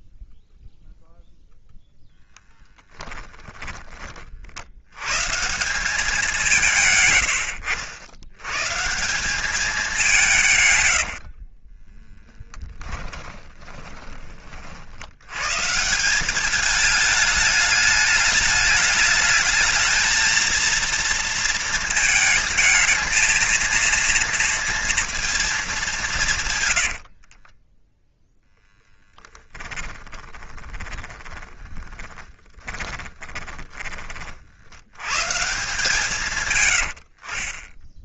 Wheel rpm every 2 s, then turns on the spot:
0, 10, 70, 160, 140, 130, 10, 60, 210, 210, 230, 220, 230, 120, 10, 20, 20, 80, 100.
2-4 10-14 30-34